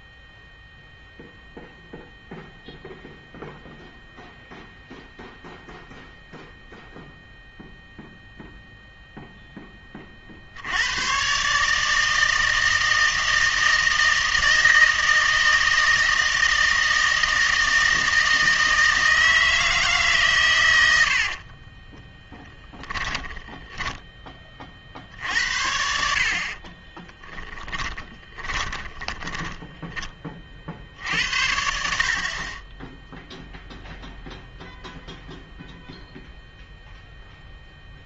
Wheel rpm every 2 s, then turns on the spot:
0, 0, 0, 0, 0, 80, 160, 160, 160, 160, 100, 10, 40, 30, 10, 50, 20, 0, 0.
22-24 26-30